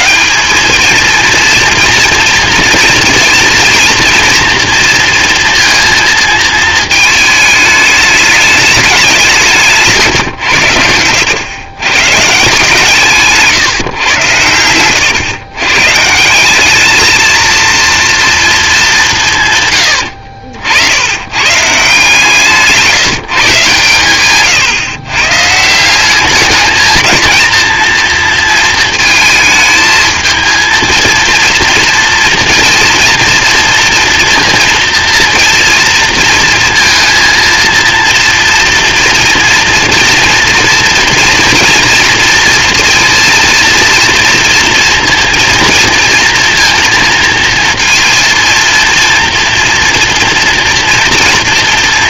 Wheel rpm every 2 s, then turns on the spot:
220, 220, 230, 220, 200, 90, 150, 100, 210, 200, 70, 160, 130, 210, 230, 220, 230, 230, 230, 230, 230, 230, 230, 230, 230, 230.
10-12 14-16 22-24